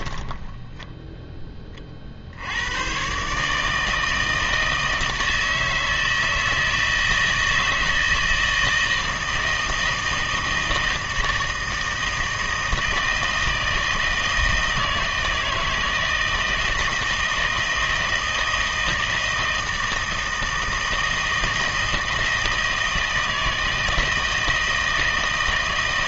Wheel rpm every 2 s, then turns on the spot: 10, 90, 160, 160, 160, 160, 160, 160, 160, 160, 160, 160, 160.
none